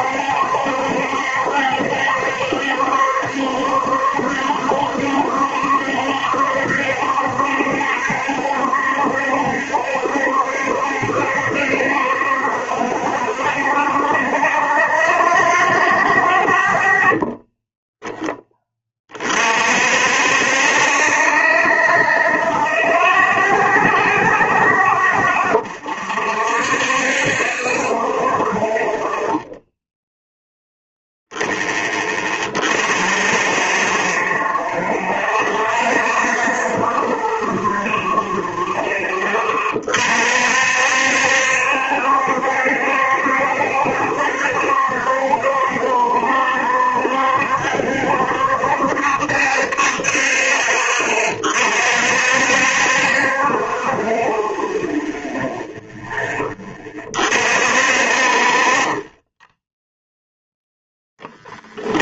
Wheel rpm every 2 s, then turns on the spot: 70, 70, 70, 70, 70, 70, 20, 0, 10, 20, 20, 0, 0, 0, 0, 0, 0, 0, 0, 10, 60, 70, 70, 70, 60, 30, 50, 0, 20, 30, 0.
58-60